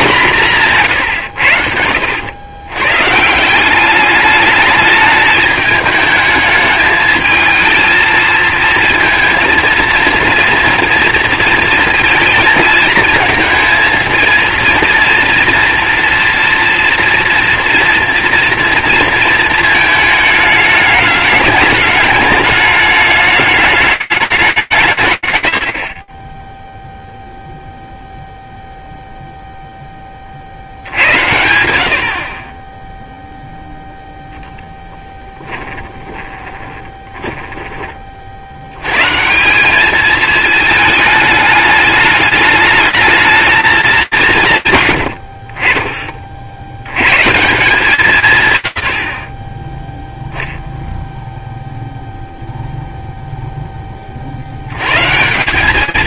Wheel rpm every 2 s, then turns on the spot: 120, 140, 210, 220, 230, 230, 220, 240, 230, 230, 210, 210, 140, 0, 0, 90, 0, 10, 20, 210, 210, 200, 30, 160, 0, 0, 30, 150.
34-36